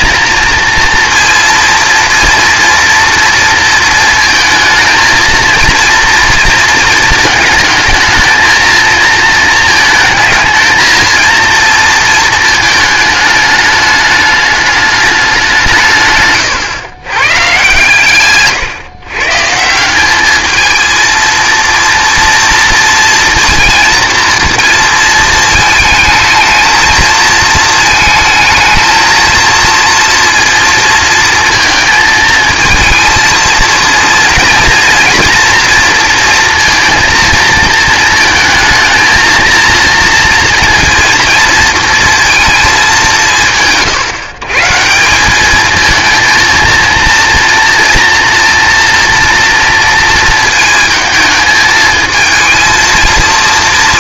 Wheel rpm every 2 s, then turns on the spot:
230, 230, 220, 230, 230, 220, 210, 210, 130, 120, 220, 230, 230, 220, 230, 230, 220, 230, 230, 230, 230, 200, 180, 230, 230, 220, 230.
none